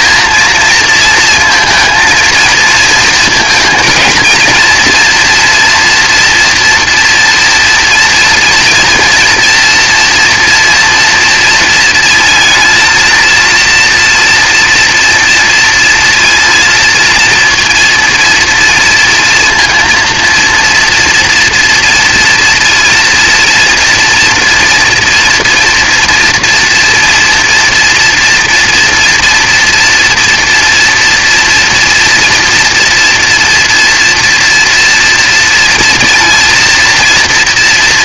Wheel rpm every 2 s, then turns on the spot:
230, 230, 240, 240, 230, 230, 230, 230, 230, 230, 230, 230, 240, 230, 230, 230, 230, 230, 230.
none